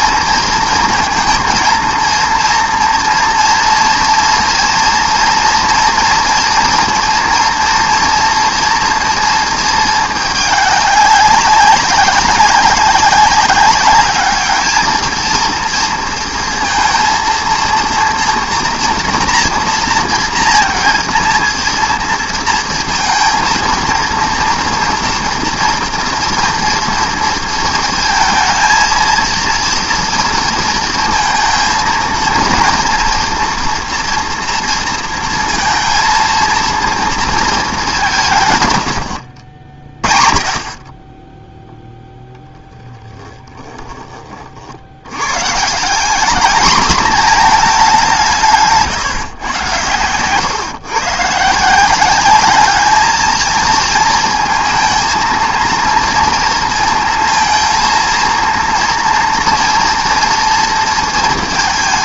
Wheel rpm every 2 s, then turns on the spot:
230, 230, 230, 230, 230, 200, 190, 220, 230, 230, 230, 230, 230, 240, 230, 230, 230, 230, 230, 110, 30, 10, 60, 220, 160, 130, 210, 220, 230, 230, 230.
42-44